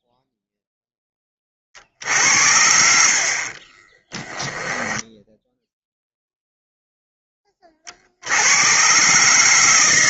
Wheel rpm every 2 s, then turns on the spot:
0, 50, 10, 0, 120.
4-6